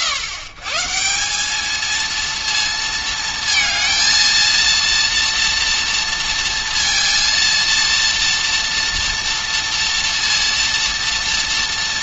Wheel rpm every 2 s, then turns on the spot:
140, 230, 230, 230, 230, 230.
none